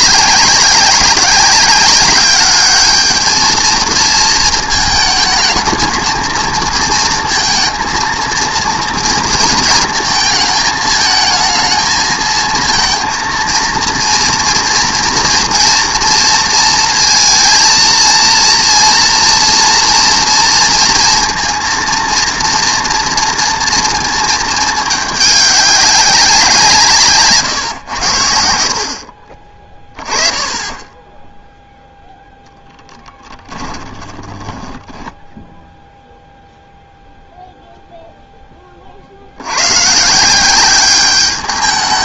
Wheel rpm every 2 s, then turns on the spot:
200, 220, 230, 230, 220, 220, 230, 230, 230, 240, 230, 230, 200, 110, 20, 0, 10, 0, 0, 50, 200.
32-34